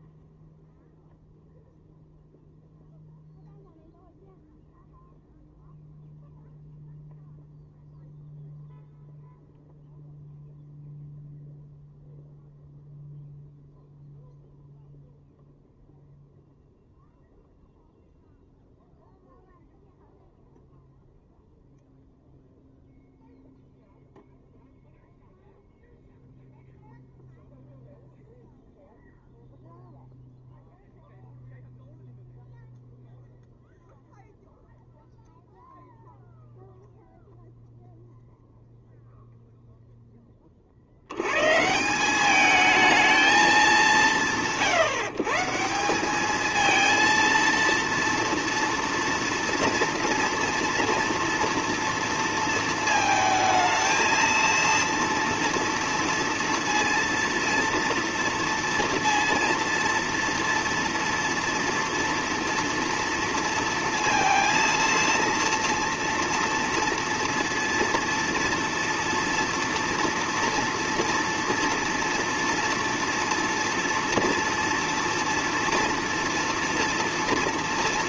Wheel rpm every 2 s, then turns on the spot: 0, 0, 0, 0, 0, 0, 0, 0, 0, 0, 0, 0, 0, 0, 0, 0, 0, 0, 0, 0, 30, 210, 130, 220, 230, 230, 230, 230, 230, 230, 230, 230, 230, 230, 230, 230, 230, 230, 230.
none